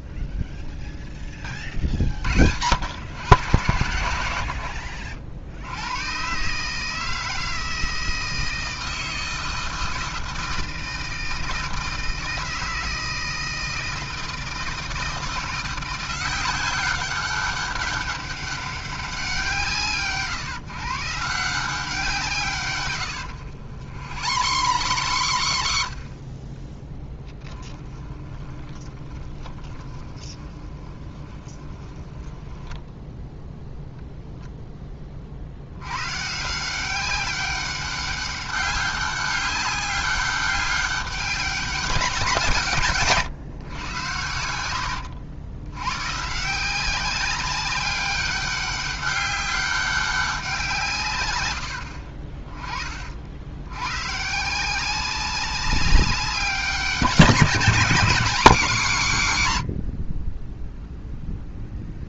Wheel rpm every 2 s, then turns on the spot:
0, 90, 70, 150, 160, 160, 160, 160, 190, 200, 140, 110, 110, 10, 20, 20, 10, 10, 180, 200, 200, 150, 80, 190, 200, 170, 30, 180, 190, 190, 0.
4-6 22-34 44-46